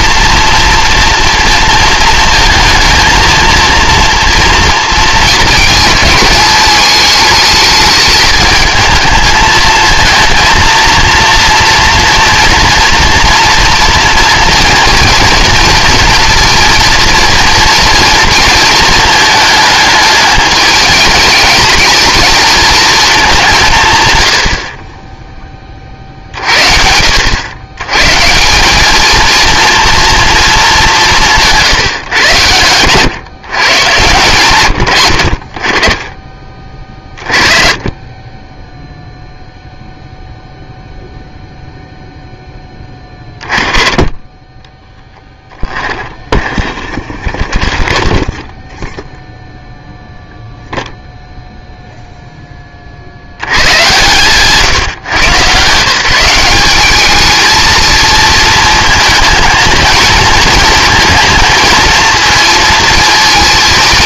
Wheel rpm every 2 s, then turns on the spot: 230, 230, 230, 210, 220, 230, 240, 230, 240, 230, 210, 230, 50, 60, 200, 200, 110, 100, 30, 10, 0, 10, 10, 10, 0, 0, 30, 140, 200, 230, 230, 230.
32-34